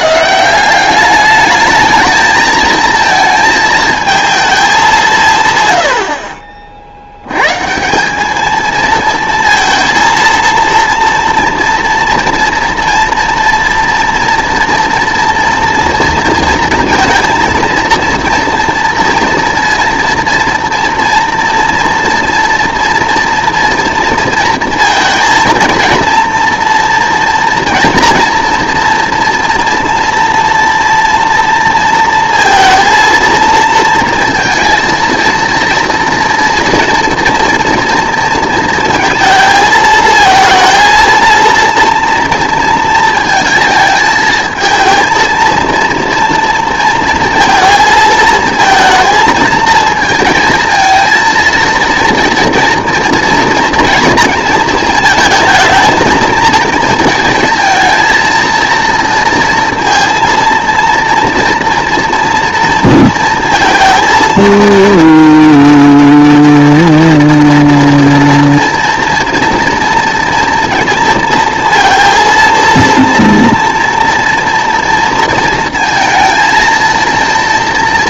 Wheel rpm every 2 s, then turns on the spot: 180, 220, 210, 50, 220, 230, 240, 240, 230, 230, 230, 230, 230, 240, 230, 230, 230, 230, 230, 230, 230, 230, 220, 230, 230, 230, 230, 230, 220, 230, 230, 230, 230, 240, 240, 230, 230, 230, 230.
none